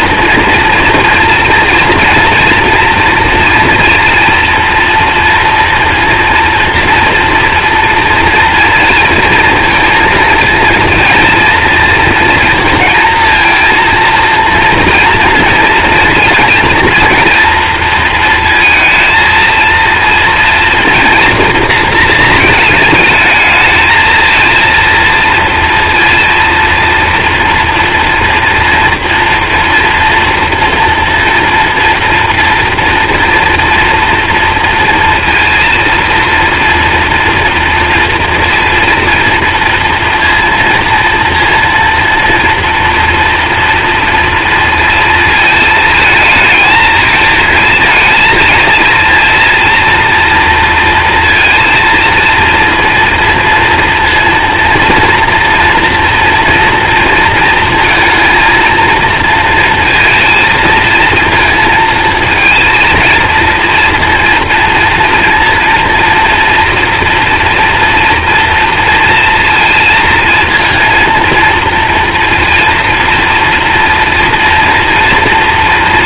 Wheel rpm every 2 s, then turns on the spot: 230, 230, 230, 230, 230, 230, 230, 230, 230, 230, 230, 220, 230, 230, 230, 230, 230, 230, 230, 230, 230, 240, 230, 230, 220, 230, 230, 230, 230, 230, 230, 230, 230, 230, 230, 230, 230, 230.
none